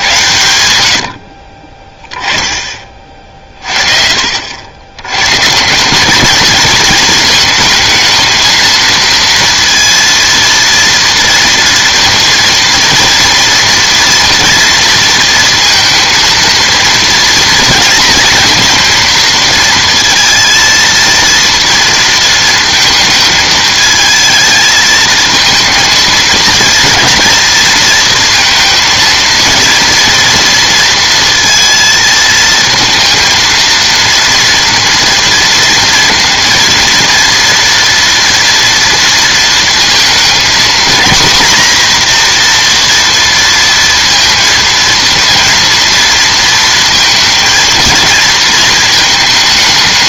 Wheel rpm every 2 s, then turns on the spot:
90, 20, 80, 230, 230, 230, 230, 230, 230, 230, 230, 230, 220, 230, 230, 230, 230, 230, 230, 230, 220, 240, 230, 230, 220.
none